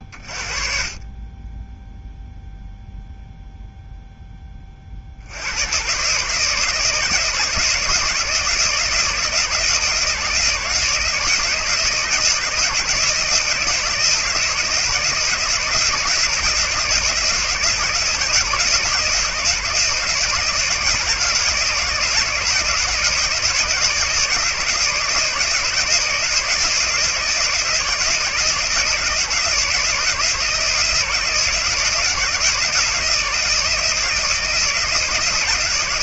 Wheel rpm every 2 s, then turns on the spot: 20, 0, 30, 150, 160, 160, 170, 160, 160, 160, 170, 160, 160, 160, 160, 160, 160, 160.
none